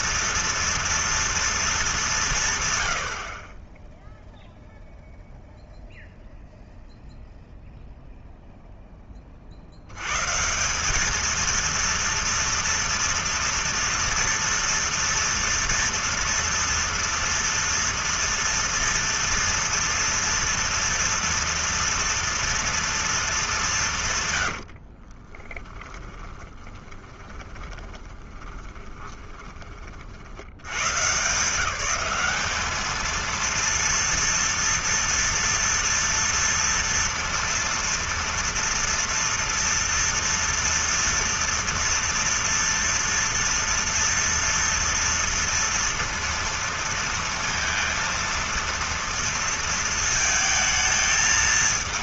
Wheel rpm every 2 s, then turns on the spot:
230, 130, 0, 0, 0, 170, 230, 240, 230, 230, 230, 230, 90, 20, 20, 90, 210, 230, 230, 230, 230, 230, 230, 230, 230, 220.
24-30